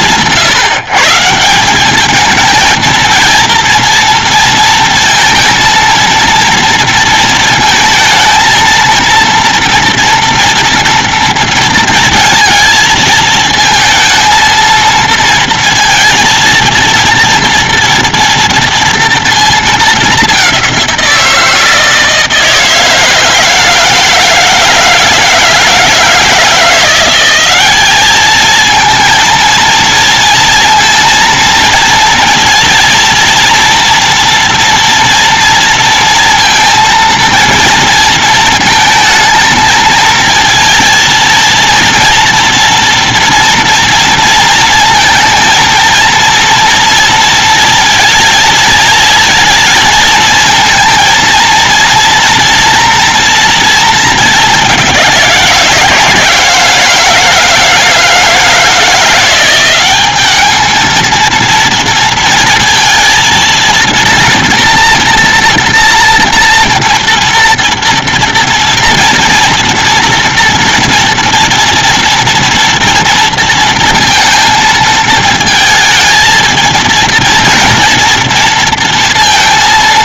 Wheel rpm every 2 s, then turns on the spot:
150, 210, 230, 230, 220, 230, 230, 230, 230, 230, 200, 160, 160, 160, 210, 230, 230, 230, 230, 230, 230, 230, 230, 230, 230, 220, 230, 210, 160, 160, 200, 230, 230, 240, 230, 230, 230, 230, 220, 230.
none